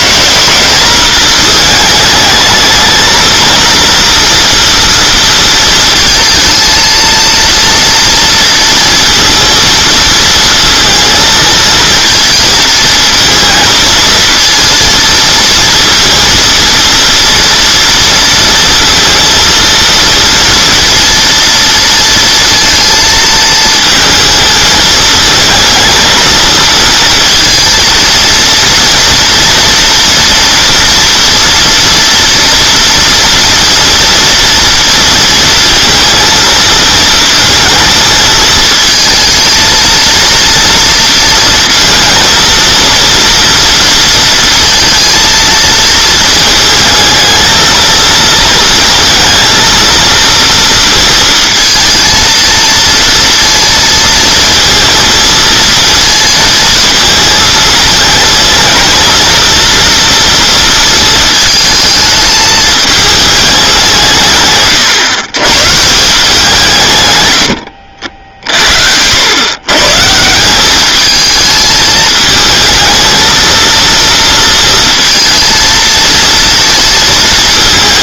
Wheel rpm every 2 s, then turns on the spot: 190, 220, 230, 220, 230, 230, 220, 230, 230, 230, 230, 230, 220, 230, 240, 230, 230, 230, 230, 220, 230, 230, 230, 220, 230, 230, 230, 230, 220, 220, 230, 220, 140, 150, 60, 200, 220, 230, 230.
none